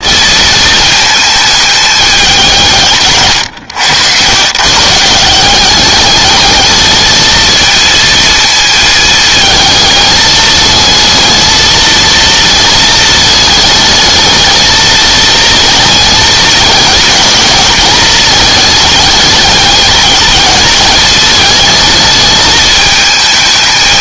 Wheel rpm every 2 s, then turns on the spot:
220, 160, 130, 220, 220, 220, 220, 220, 210, 210, 210, 220.
none